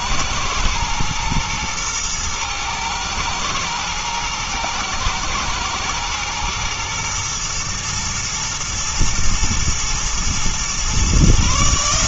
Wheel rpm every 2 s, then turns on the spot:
110, 110, 110, 120, 120, 120.
none